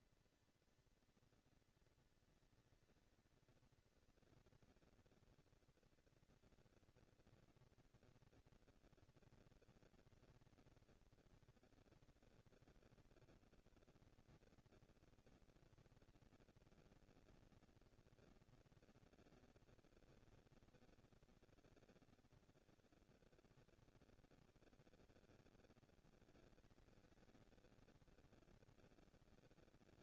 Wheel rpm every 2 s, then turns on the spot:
230, 220, 230, 230, 230, 230, 230, 230, 230, 230, 210, 150, 110, 190, 210.
none